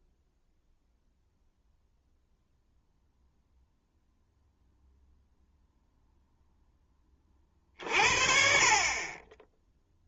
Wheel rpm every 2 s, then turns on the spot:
0, 0, 0, 10, 40.
none